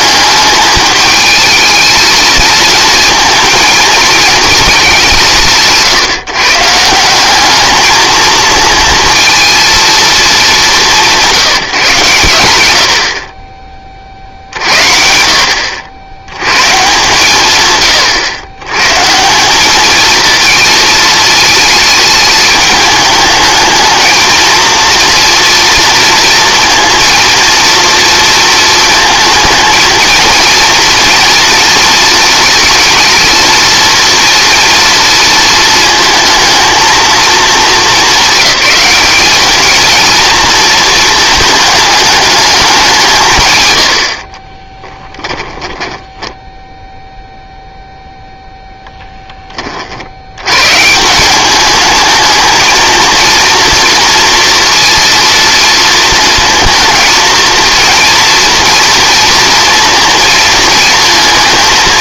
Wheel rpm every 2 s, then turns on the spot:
210, 220, 210, 160, 230, 180, 100, 60, 130, 120, 220, 210, 230, 230, 230, 230, 230, 230, 230, 200, 230, 190, 20, 0, 0, 130, 220, 230, 230, 230, 220.
44-46